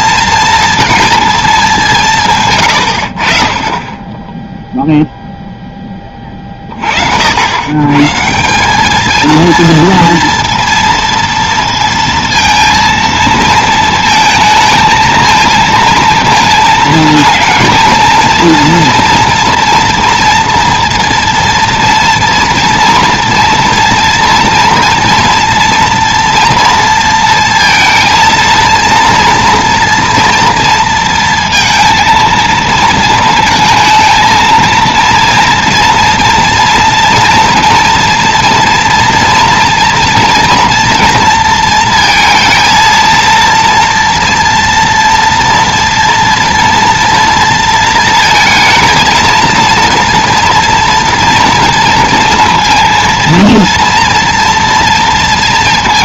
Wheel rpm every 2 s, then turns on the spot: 230, 130, 0, 30, 180, 230, 230, 220, 230, 230, 230, 230, 230, 230, 230, 230, 230, 230, 230, 230, 230, 230, 230, 230, 220, 230, 230, 230.
none